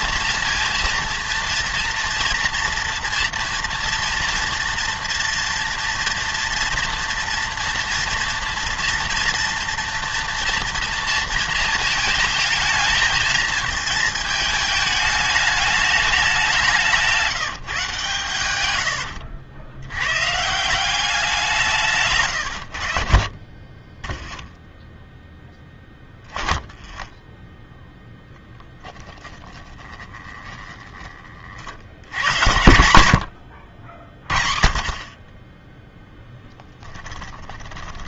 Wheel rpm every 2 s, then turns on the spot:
230, 230, 230, 230, 230, 230, 220, 220, 190, 110, 160, 90, 0, 10, 10, 20, 100, 50, 10.
28-32 36-38